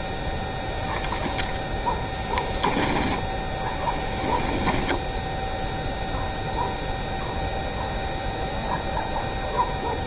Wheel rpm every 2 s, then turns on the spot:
10, 10, 0, 0, 0.
none